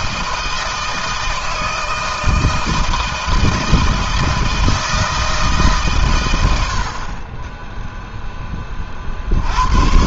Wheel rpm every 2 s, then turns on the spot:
160, 160, 160, 50, 50.
none